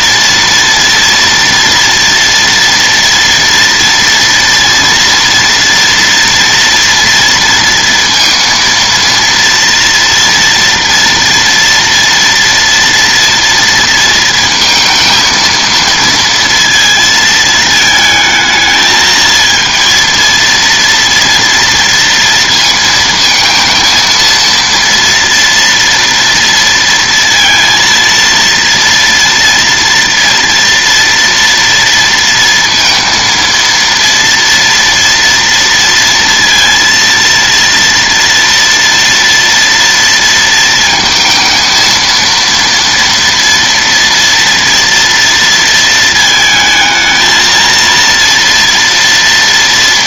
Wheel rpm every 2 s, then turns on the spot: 230, 230, 230, 240, 230, 230, 230, 230, 230, 220, 230, 230, 230, 230, 230, 230, 230, 230, 230, 230, 230, 230, 240, 220, 230.
none